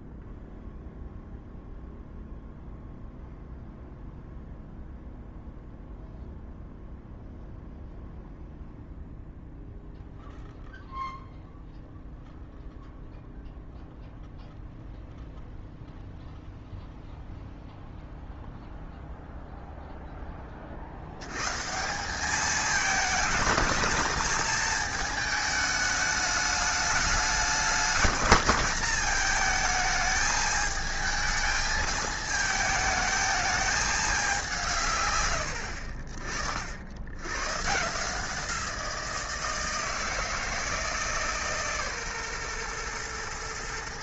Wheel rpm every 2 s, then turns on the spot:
0, 0, 0, 0, 0, 0, 0, 0, 0, 0, 60, 210, 220, 210, 220, 220, 220, 160, 70, 170, 160, 120.
none